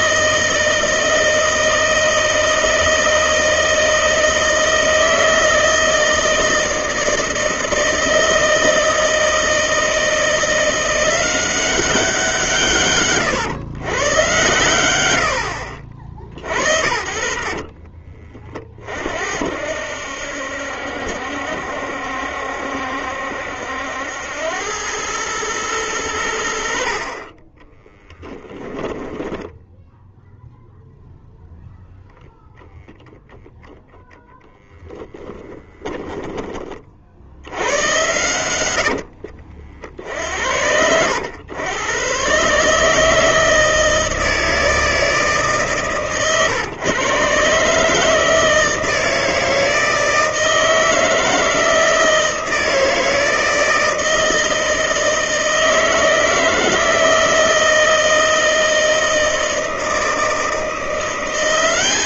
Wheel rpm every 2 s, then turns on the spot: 160, 160, 160, 160, 160, 180, 140, 100, 70, 50, 70, 70, 100, 50, 10, 0, 0, 10, 40, 80, 90, 150, 160, 130, 160, 160, 160, 160, 160, 160, 170.
14-18 28-30